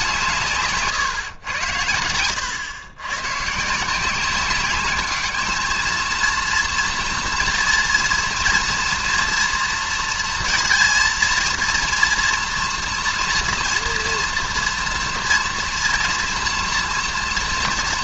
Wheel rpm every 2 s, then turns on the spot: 140, 100, 200, 230, 230, 230, 240, 240, 230.
0-2